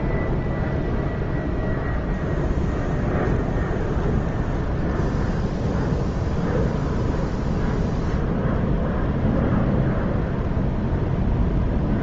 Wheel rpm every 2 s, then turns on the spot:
0, 0, 0, 0, 0, 0.
none